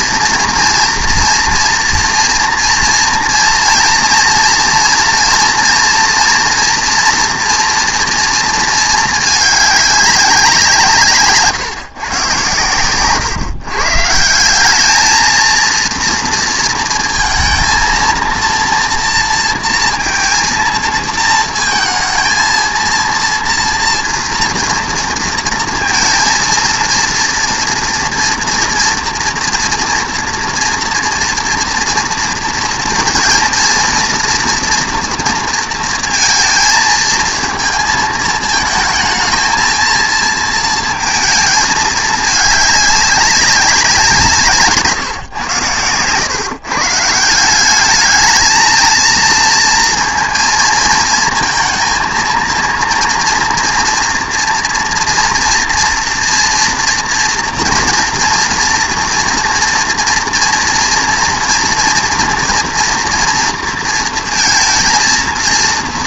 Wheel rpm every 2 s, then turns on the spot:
230, 230, 230, 240, 220, 170, 130, 210, 230, 230, 220, 230, 240, 230, 240, 240, 230, 230, 230, 220, 230, 210, 150, 140, 220, 220, 230, 230, 230, 230, 230, 230, 220.
none